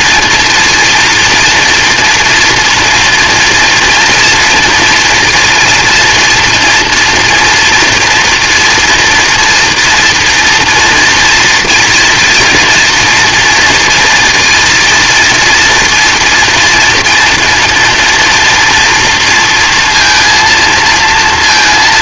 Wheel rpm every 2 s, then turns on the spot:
230, 230, 240, 230, 230, 230, 230, 230, 230, 240, 230.
none